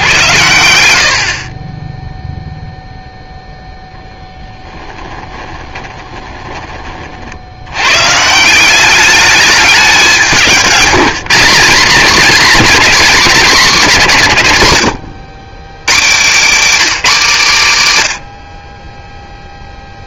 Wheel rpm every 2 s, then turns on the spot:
90, 0, 10, 30, 180, 170, 200, 120, 250, 30.
4-6